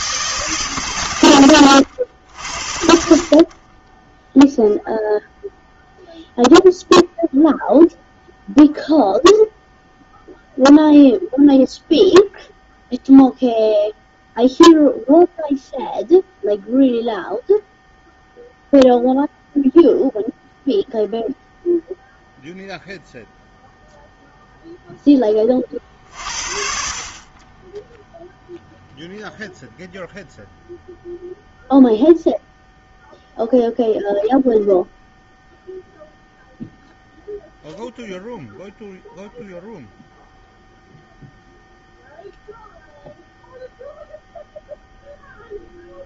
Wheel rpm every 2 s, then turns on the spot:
150, 80, 0, 0, 0, 0, 0, 0, 0, 0, 0, 0, 0, 60, 0, 0, 0, 0, 0, 0, 0, 0, 0.
none